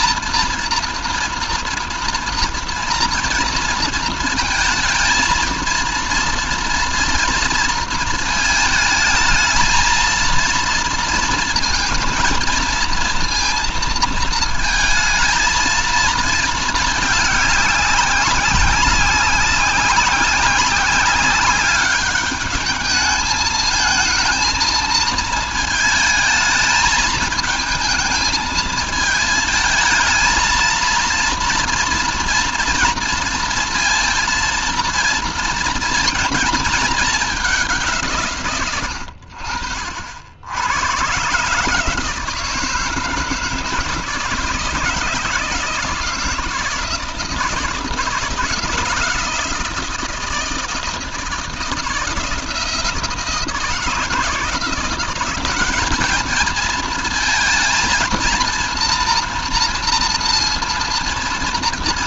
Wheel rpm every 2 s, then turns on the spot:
230, 230, 230, 230, 220, 230, 230, 220, 210, 190, 200, 210, 230, 220, 220, 230, 230, 230, 220, 90, 110, 160, 160, 160, 170, 160, 160, 180, 220, 230, 230.
none